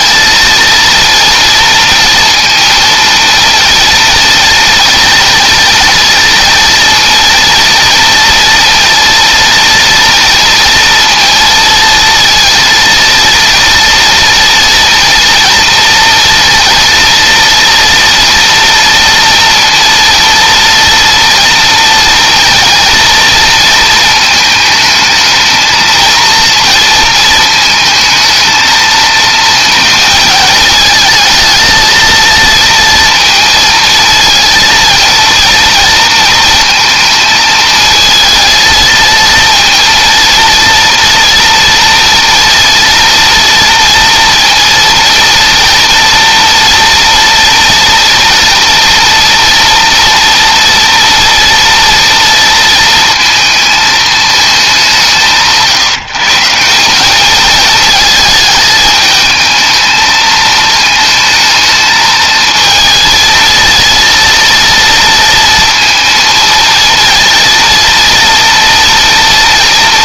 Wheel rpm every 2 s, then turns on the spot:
240, 230, 230, 230, 230, 230, 230, 230, 230, 240, 230, 230, 220, 220, 220, 220, 230, 230, 230, 230, 230, 230, 230, 240, 230, 230, 230, 190, 190, 220, 220, 220, 230, 230, 230.
none